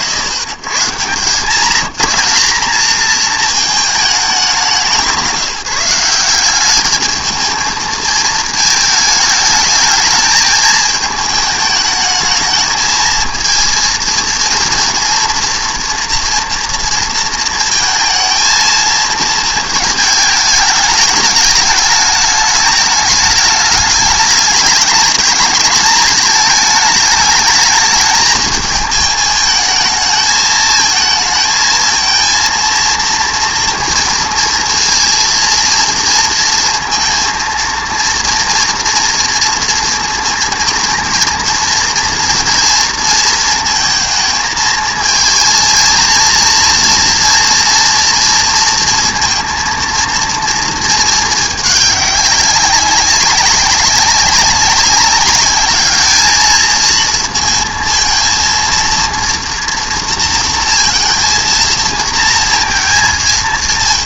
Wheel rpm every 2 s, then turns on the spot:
130, 210, 180, 200, 210, 210, 220, 230, 230, 220, 210, 210, 210, 220, 220, 220, 230, 230, 230, 230, 220, 230, 220, 230, 230, 230, 200, 190, 220, 230, 230, 230.
none